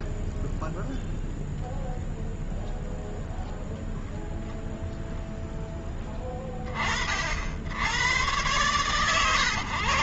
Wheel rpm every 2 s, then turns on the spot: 0, 0, 0, 20, 100.
none